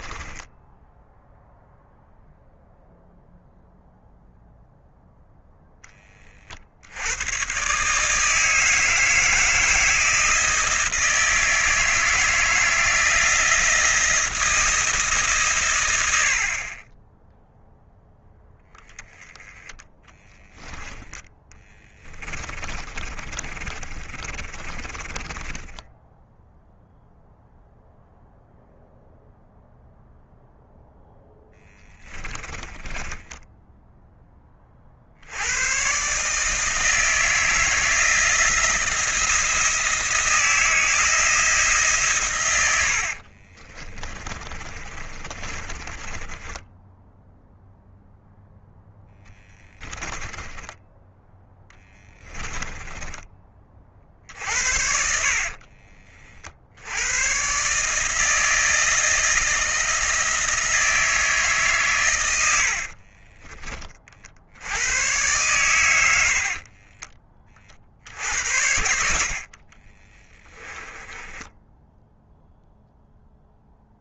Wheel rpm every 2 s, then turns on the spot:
10, 0, 0, 70, 160, 160, 160, 160, 30, 10, 10, 30, 40, 0, 0, 0, 20, 40, 160, 170, 160, 80, 30, 20, 10, 20, 10, 60, 80, 160, 160, 70, 100, 30, 70, 10, 0.
0-2 22-26 32-34 44-48 50-56 62-64 66-68 70-72